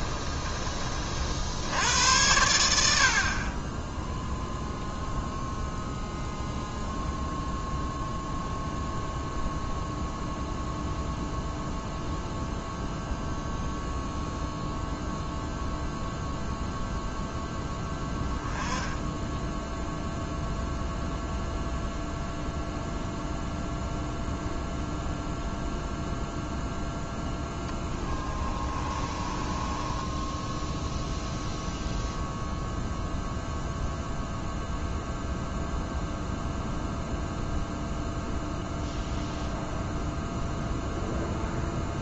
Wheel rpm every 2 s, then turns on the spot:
40, 60, 0, 0, 0, 0, 0, 0, 0, 10, 0, 0, 0, 10, 30, 0, 0, 0, 0, 0, 0.
28-30